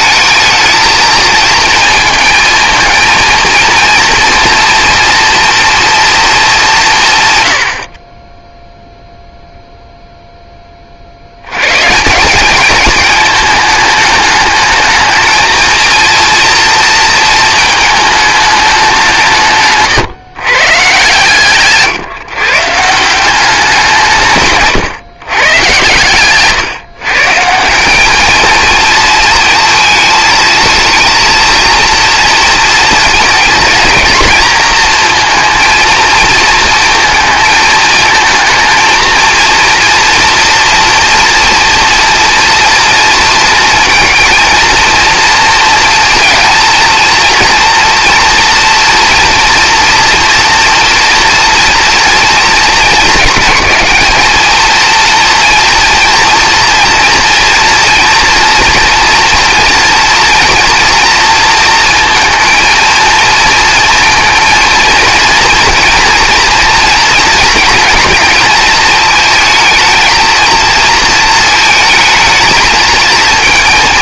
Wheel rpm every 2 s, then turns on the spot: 220, 220, 240, 190, 0, 40, 210, 220, 230, 200, 130, 160, 130, 140, 230, 230, 220, 220, 230, 230, 230, 230, 230, 230, 230, 230, 220, 230, 230, 230, 230, 230, 230, 240, 220, 220, 230.
none